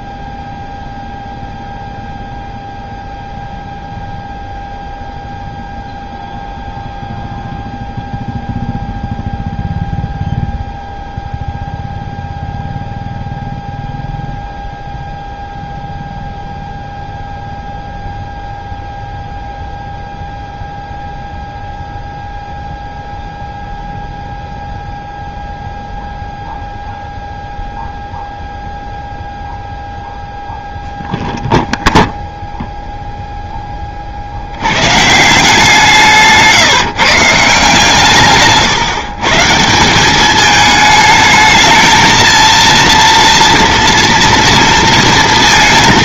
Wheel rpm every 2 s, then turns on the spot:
0, 0, 0, 0, 0, 0, 0, 0, 0, 0, 0, 0, 0, 0, 0, 0, 0, 90, 160, 150, 210, 230, 230.
38-40